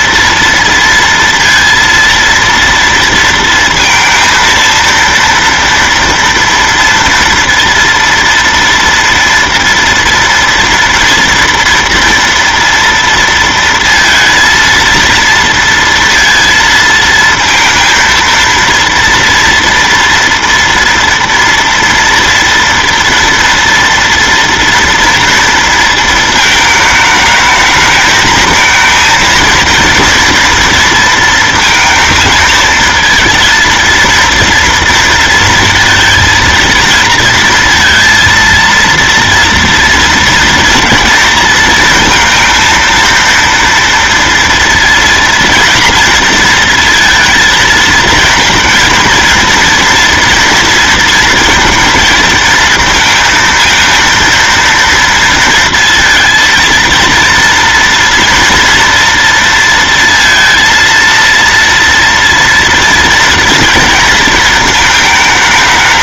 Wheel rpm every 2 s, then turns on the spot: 230, 230, 230, 240, 230, 230, 230, 230, 230, 230, 230, 230, 230, 220, 220, 230, 220, 230, 230, 230, 230, 230, 230, 230, 230, 230, 230, 230, 230, 230, 230, 230, 220.
none